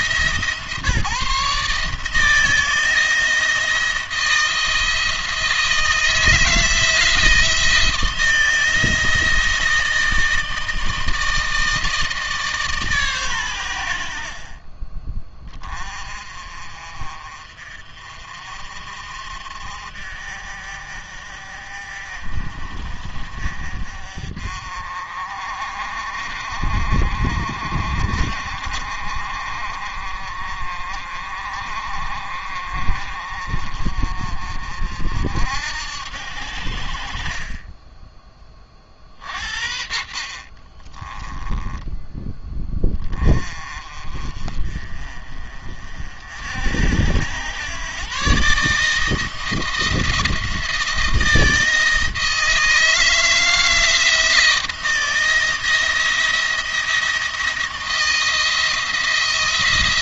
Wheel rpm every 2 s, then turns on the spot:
150, 160, 160, 160, 170, 160, 150, 40, 40, 50, 50, 50, 40, 40, 40, 40, 40, 50, 60, 30, 30, 10, 40, 70, 150, 170, 160, 170, 160, 160.
40-42